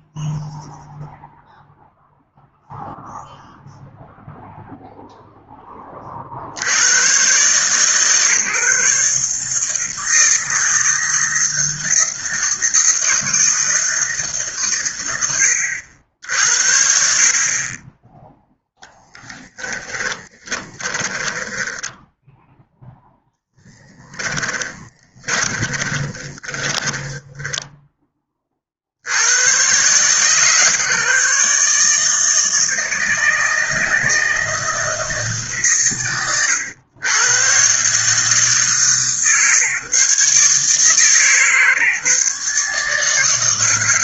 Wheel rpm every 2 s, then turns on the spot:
0, 0, 0, 100, 150, 160, 160, 120, 50, 10, 40, 0, 20, 20, 70, 150, 160, 160, 100, 140, 150, 150.
18-22 24-28